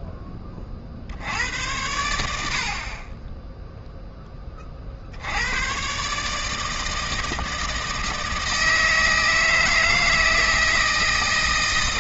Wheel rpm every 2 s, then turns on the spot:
40, 50, 40, 160, 160, 160.
none